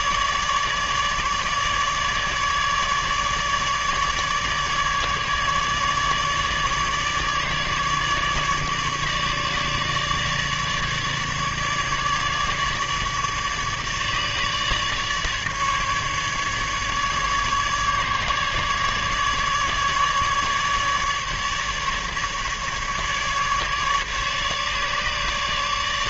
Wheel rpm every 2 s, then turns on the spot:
150, 150, 150, 150, 150, 150, 150, 150, 150, 150, 150, 150, 150.
none